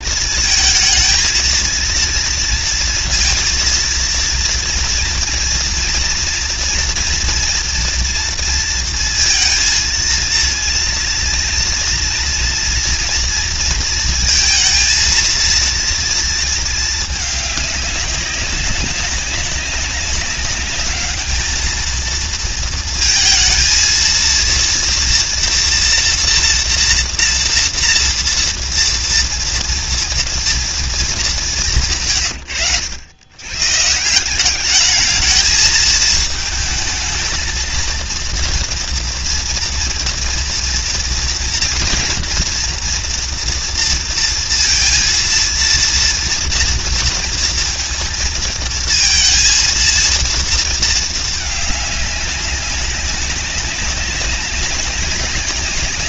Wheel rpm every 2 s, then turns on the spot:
230, 230, 230, 230, 230, 230, 230, 230, 230, 200, 200, 220, 220, 230, 240, 240, 150, 140, 220, 230, 230, 230, 230, 230, 230, 230, 200, 190.
32-34